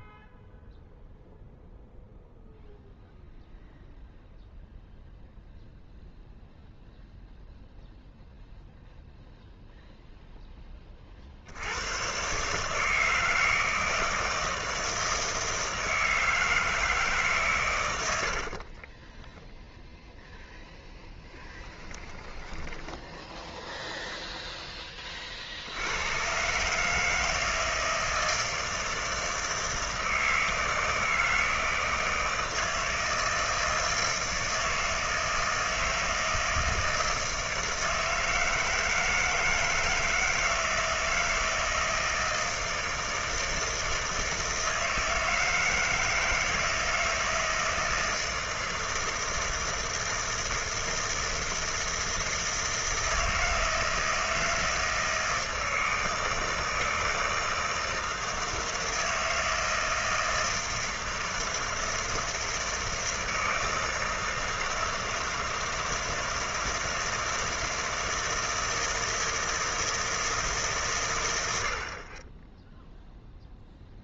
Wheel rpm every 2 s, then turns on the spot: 0, 0, 0, 0, 0, 10, 150, 160, 160, 40, 10, 10, 30, 160, 160, 160, 160, 160, 160, 160, 160, 160, 160, 160, 160, 160, 160, 160, 160, 160, 160, 160, 160, 160, 160, 130, 0.
18-20 22-24